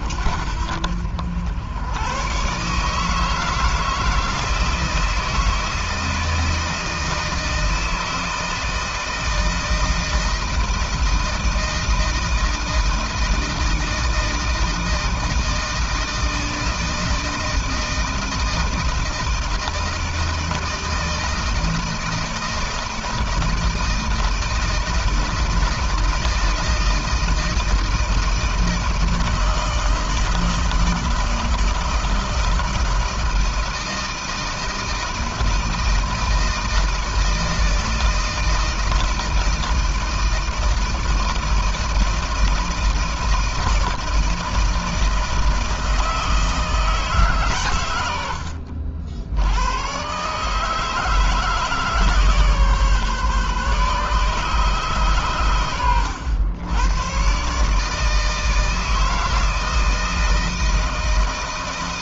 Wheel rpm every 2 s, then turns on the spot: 60, 130, 160, 160, 160, 160, 160, 160, 160, 160, 160, 160, 160, 160, 160, 160, 160, 160, 160, 160, 160, 160, 160, 160, 70, 150, 150, 150, 90, 160, 160.
none